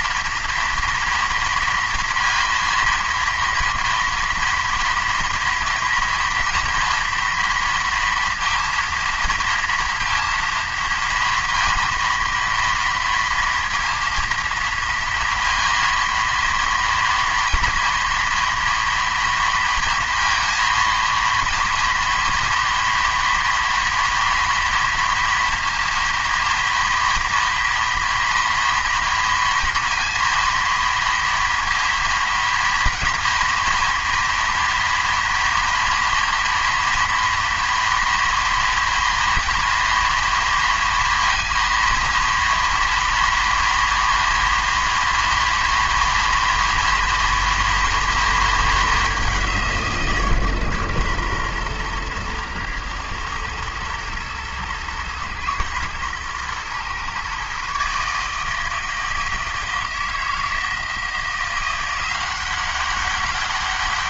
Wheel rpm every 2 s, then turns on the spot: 230, 230, 230, 230, 230, 230, 230, 230, 230, 230, 230, 230, 240, 230, 230, 230, 230, 230, 240, 230, 230, 230, 230, 230, 220, 130, 120, 110, 120, 160, 160, 190.
none